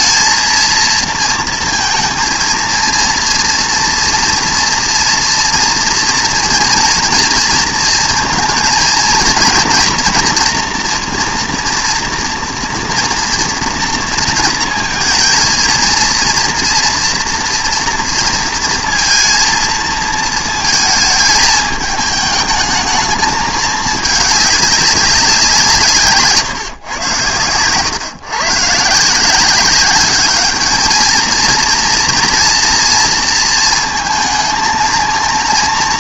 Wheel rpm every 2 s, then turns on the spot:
230, 230, 230, 230, 230, 240, 230, 230, 230, 230, 230, 220, 210, 130, 140, 220, 230, 220.
none